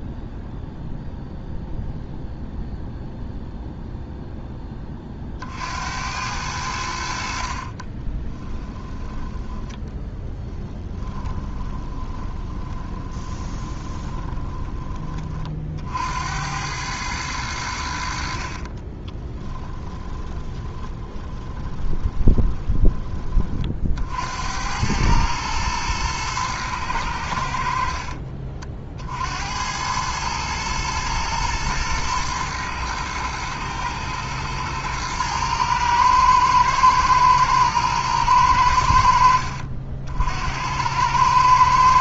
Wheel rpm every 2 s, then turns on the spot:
0, 0, 30, 70, 10, 20, 20, 20, 100, 30, 20, 20, 100, 100, 50, 110, 110, 110, 110, 80, 90.
10-14 18-22